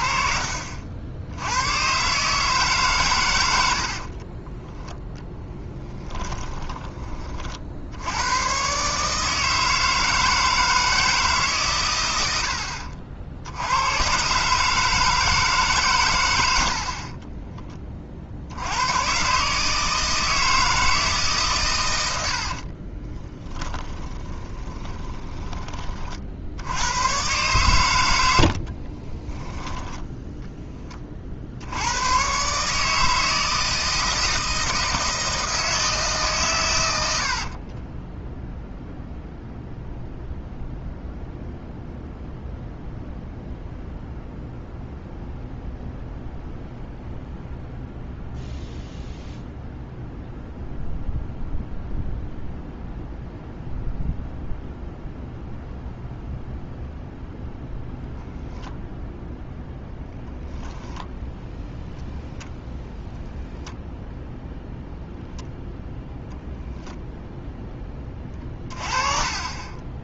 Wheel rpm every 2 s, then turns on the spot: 50, 140, 10, 20, 120, 160, 70, 150, 60, 80, 160, 40, 20, 90, 90, 10, 150, 160, 110, 0, 0, 0, 0, 0, 0, 0, 0, 0, 0, 0, 0, 0, 0, 10, 30.
4-8 22-26